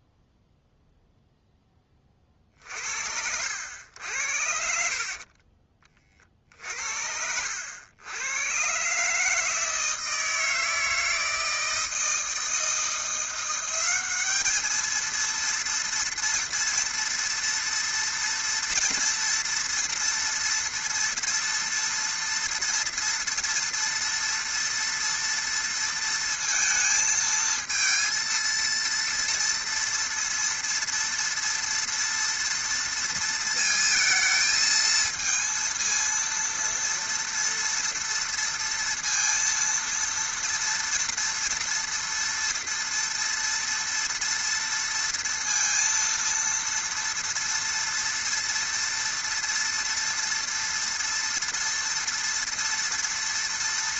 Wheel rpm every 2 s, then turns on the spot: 0, 40, 60, 50, 120, 160, 160, 210, 240, 230, 230, 230, 230, 230, 230, 230, 230, 220, 230, 230, 230, 240, 230, 230, 230, 230, 230.
none